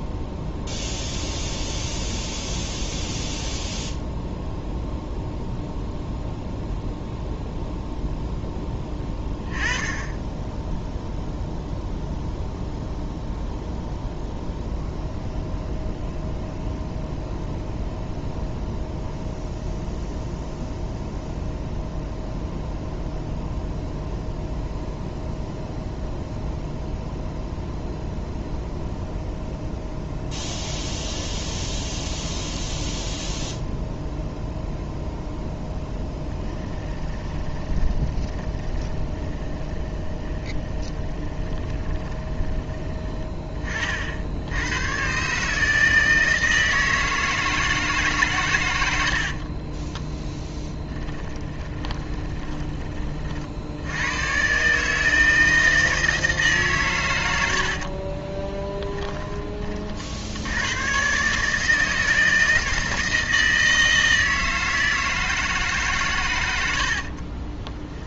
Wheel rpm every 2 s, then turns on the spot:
0, 0, 0, 0, 10, 10, 0, 0, 0, 0, 0, 0, 0, 0, 0, 0, 0, 0, 20, 20, 20, 20, 100, 160, 100, 10, 30, 140, 140, 10, 100, 160, 160, 90.
36-42 50-52 58-60